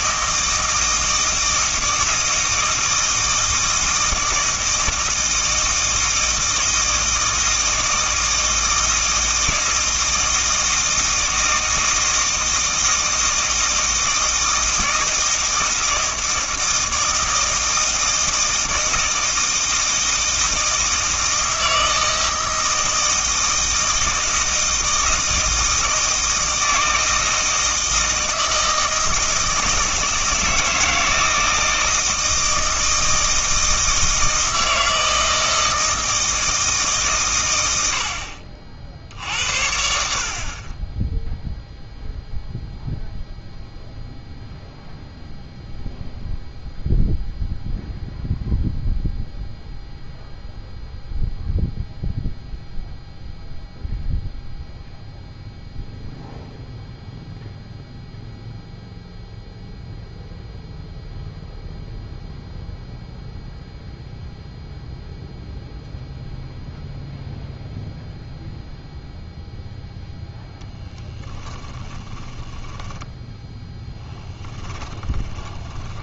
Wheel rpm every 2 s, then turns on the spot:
160, 160, 160, 160, 160, 160, 160, 160, 160, 160, 160, 160, 160, 160, 160, 160, 160, 160, 150, 60, 20, 0, 0, 0, 0, 0, 0, 0, 0, 0, 0, 0, 0, 0, 0, 0, 10, 10.
74-76